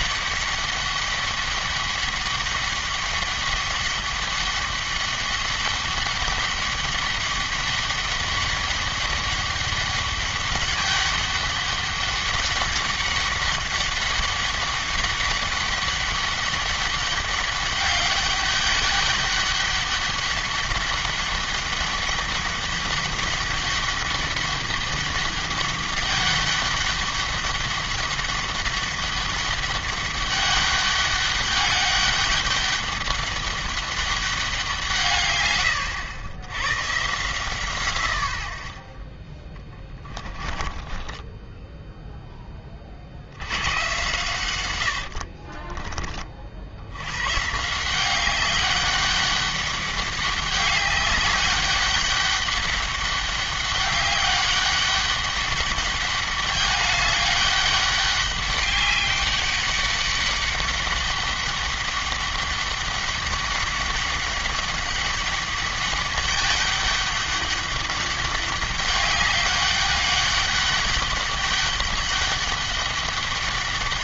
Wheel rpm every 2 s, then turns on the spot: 200, 200, 200, 200, 200, 200, 200, 200, 200, 200, 200, 200, 200, 200, 200, 200, 200, 170, 120, 70, 20, 30, 110, 60, 200, 200, 200, 200, 200, 200, 200, 200, 200, 200, 200, 200, 200.
40-42